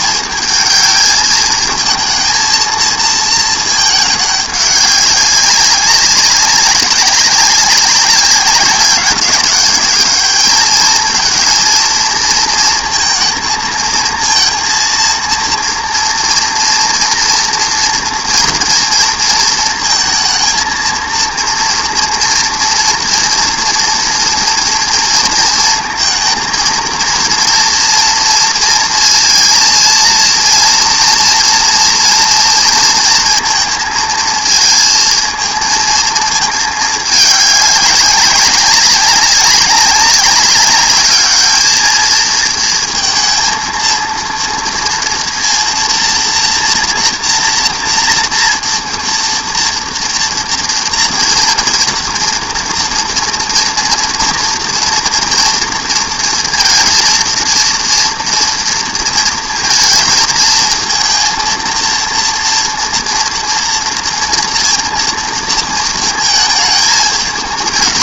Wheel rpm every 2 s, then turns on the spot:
220, 230, 200, 200, 200, 220, 230, 230, 230, 230, 230, 230, 230, 230, 230, 230, 230, 230, 220, 200, 200, 230, 230, 230, 240, 230, 230, 230, 230, 230, 220, 230, 230, 220.
none